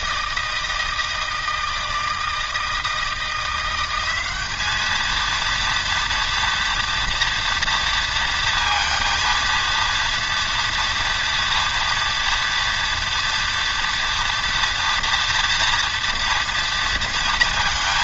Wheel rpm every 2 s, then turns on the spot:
160, 160, 200, 230, 230, 230, 230, 230, 230.
none